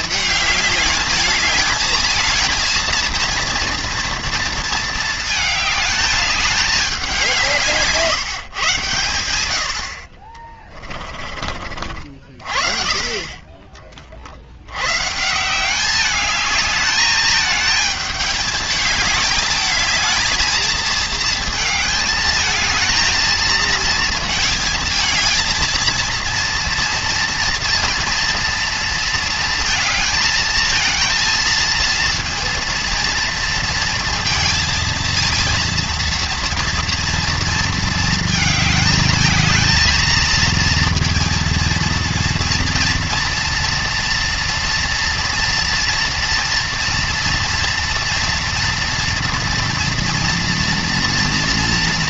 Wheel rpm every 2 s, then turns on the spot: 210, 230, 230, 200, 120, 20, 30, 130, 210, 210, 220, 220, 220, 230, 230, 230, 230, 230, 230, 220, 230, 230, 240, 230, 230, 230.
10-12